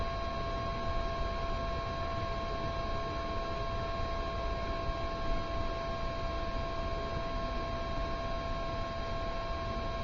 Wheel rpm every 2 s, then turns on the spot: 0, 0, 0, 0, 0.
none